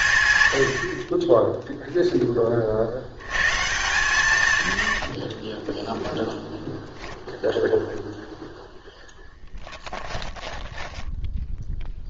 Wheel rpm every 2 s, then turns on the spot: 80, 50, 100, 0, 0, 10.
4-6 10-12